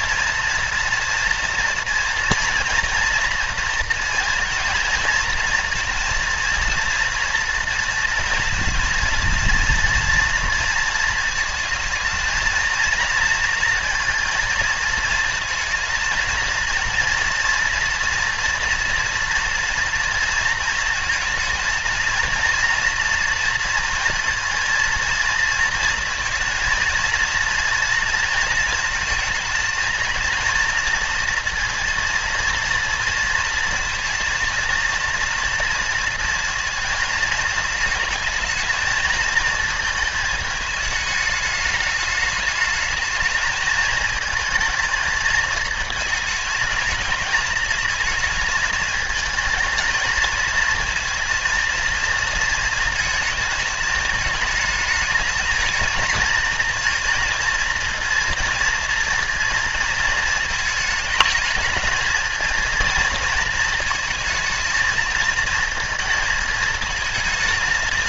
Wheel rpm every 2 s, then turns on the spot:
240, 230, 230, 230, 230, 230, 220, 230, 230, 230, 230, 230, 230, 230, 220, 230, 230, 230, 230, 230, 220, 210, 220, 220, 220, 230, 230, 220, 230, 230, 220, 220, 230, 220.
none